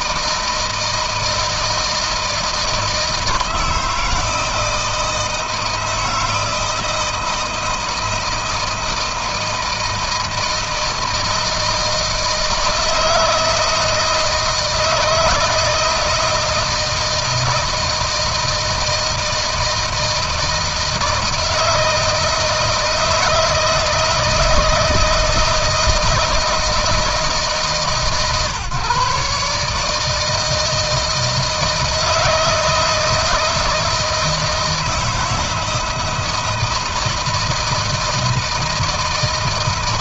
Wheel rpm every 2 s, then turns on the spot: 160, 160, 160, 160, 160, 160, 160, 160, 160, 160, 160, 160, 160, 160, 140, 160, 160, 160, 160, 160.
none